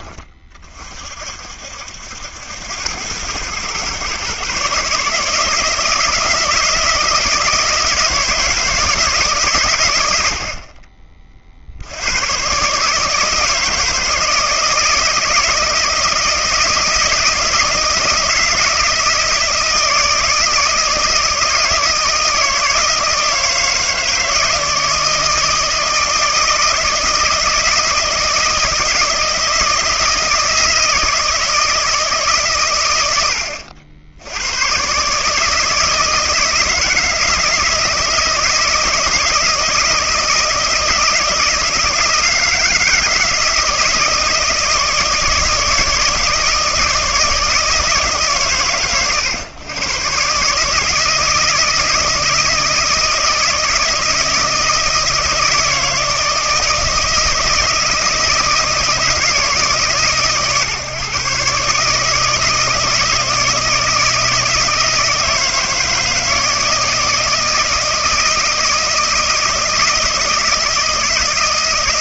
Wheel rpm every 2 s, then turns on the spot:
40, 90, 140, 160, 160, 50, 140, 160, 160, 160, 160, 160, 160, 160, 160, 160, 120, 120, 160, 160, 160, 160, 160, 160, 120, 150, 160, 160, 160, 160, 130, 160, 160, 160, 160, 160.
none